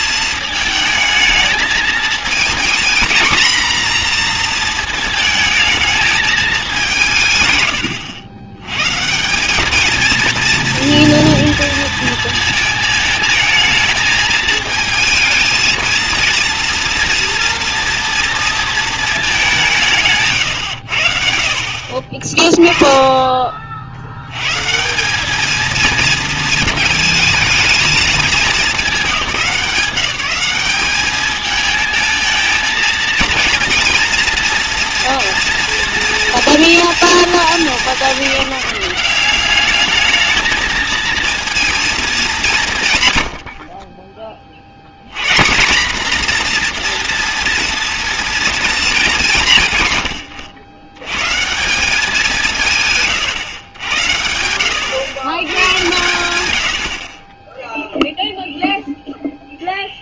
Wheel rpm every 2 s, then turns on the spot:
220, 230, 230, 210, 120, 230, 220, 220, 230, 230, 120, 10, 140, 230, 210, 190, 220, 230, 230, 170, 220, 150, 60, 240, 230, 100, 160, 90, 80, 0.
22-24